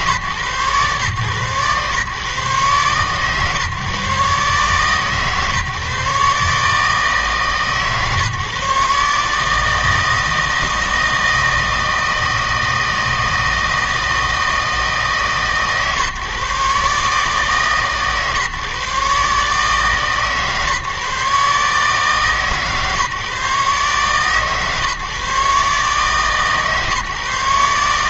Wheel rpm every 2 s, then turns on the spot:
130, 130, 140, 150, 150, 160, 160, 160, 140, 140, 150, 150, 140, 150.
none